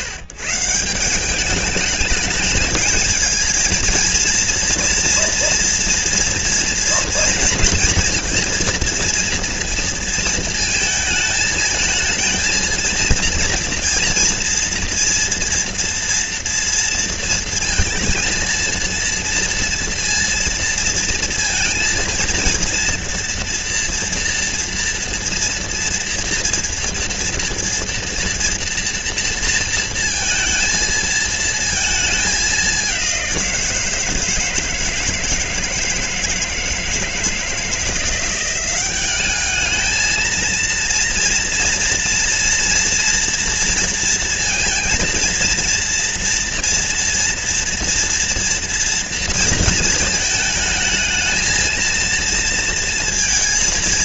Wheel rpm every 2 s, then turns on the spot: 150, 220, 230, 230, 230, 220, 230, 230, 230, 230, 230, 230, 240, 230, 230, 220, 190, 160, 160, 190, 230, 230, 230, 240, 240, 220, 230.
none